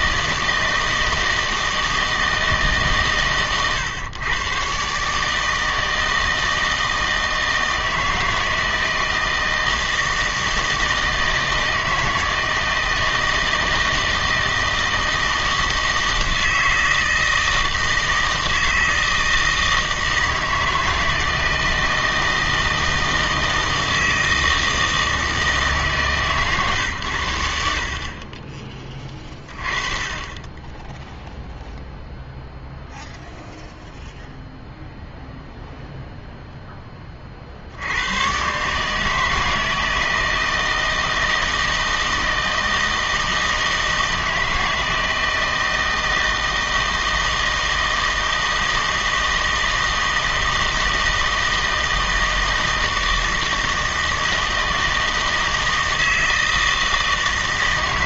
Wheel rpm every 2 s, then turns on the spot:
160, 160, 140, 160, 160, 160, 160, 160, 160, 160, 160, 160, 160, 130, 20, 10, 0, 0, 0, 130, 160, 160, 160, 160, 160, 160, 160, 160, 160.
none